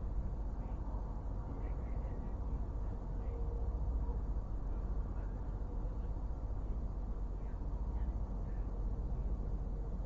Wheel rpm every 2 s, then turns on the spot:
0, 0, 0, 0, 0.
none